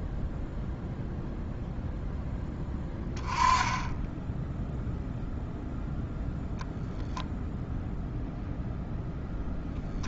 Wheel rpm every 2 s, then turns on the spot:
0, 10, 0, 0, 0.
none